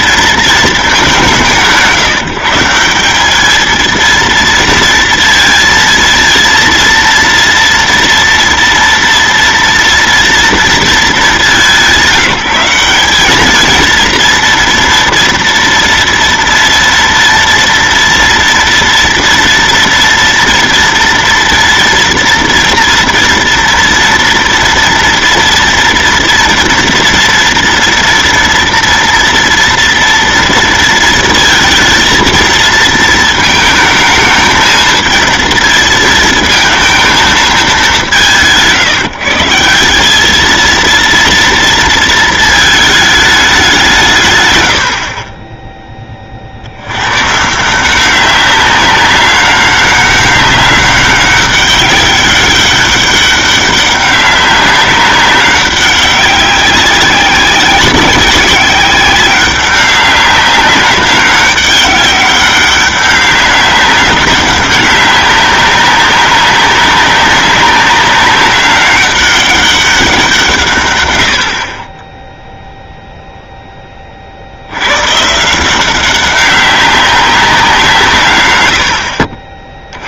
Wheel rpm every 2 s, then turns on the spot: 220, 170, 230, 230, 230, 230, 190, 230, 230, 230, 230, 230, 230, 240, 230, 230, 230, 220, 220, 150, 230, 220, 100, 70, 200, 200, 200, 190, 190, 190, 200, 200, 200, 190, 200, 150, 0, 80, 200, 100.
none